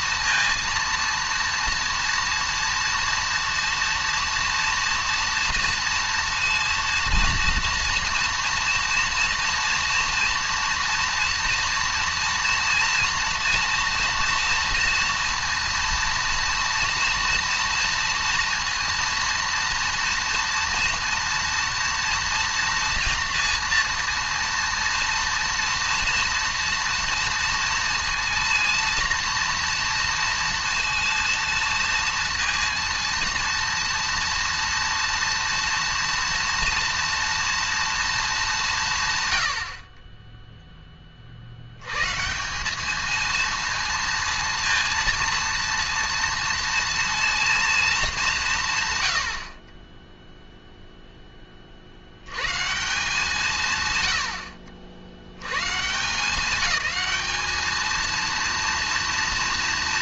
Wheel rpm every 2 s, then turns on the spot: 230, 230, 230, 230, 230, 230, 230, 230, 230, 230, 230, 240, 230, 230, 230, 230, 230, 230, 230, 190, 10, 190, 230, 230, 170, 0, 130, 70, 210, 230.
none